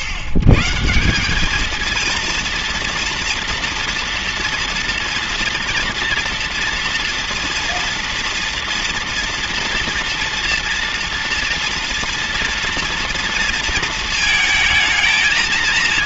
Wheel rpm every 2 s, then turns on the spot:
130, 230, 230, 230, 230, 230, 230, 220.
none